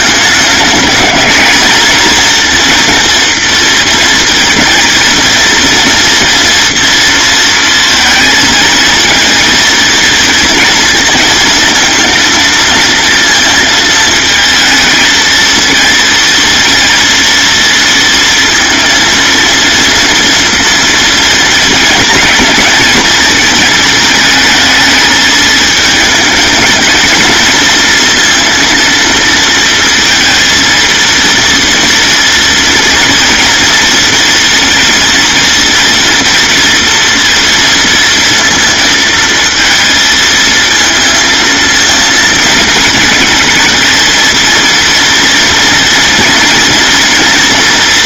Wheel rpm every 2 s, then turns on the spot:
210, 230, 230, 230, 220, 230, 230, 220, 230, 230, 230, 220, 220, 220, 230, 230, 230, 240, 230, 230, 230, 220, 230, 230.
none